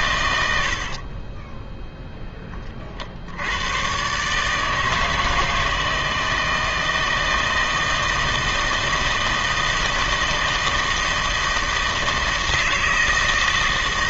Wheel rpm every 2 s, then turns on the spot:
70, 30, 160, 160, 160, 160, 160.
none